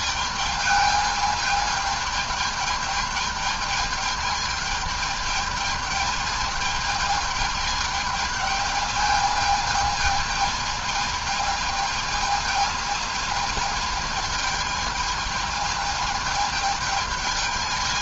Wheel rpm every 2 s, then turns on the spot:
220, 220, 220, 220, 220, 220, 220, 210, 220.
none